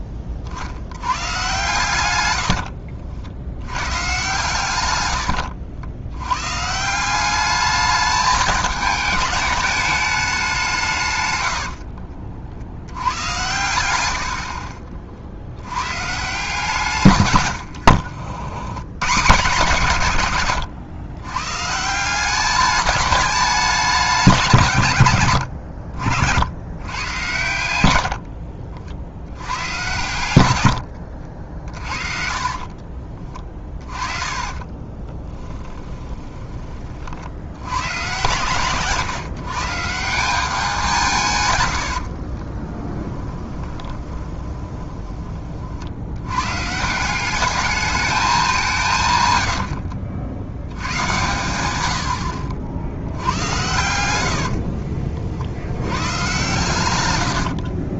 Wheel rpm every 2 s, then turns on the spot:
50, 70, 120, 140, 210, 180, 70, 60, 140, 90, 110, 200, 170, 100, 50, 100, 40, 20, 30, 130, 190, 20, 20, 140, 180, 90, 70, 60, 120.
2-4 30-36 42-46 54-56